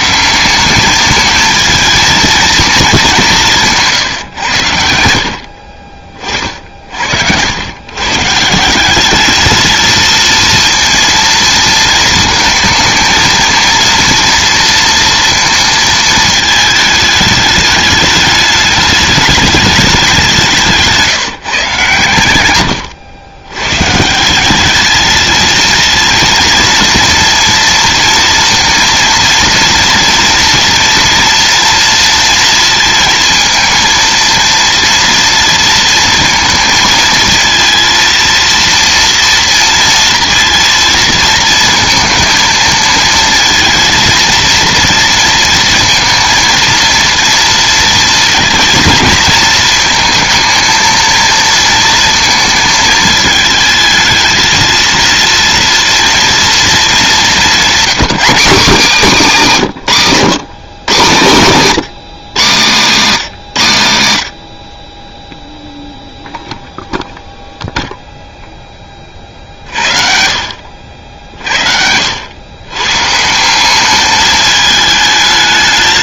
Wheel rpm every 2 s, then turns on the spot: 200, 220, 90, 60, 170, 230, 230, 230, 220, 210, 170, 100, 200, 220, 230, 240, 230, 230, 230, 230, 230, 220, 230, 230, 230, 230, 220, 230, 230, 210, 140, 150, 40, 0, 10, 70, 120, 220.
none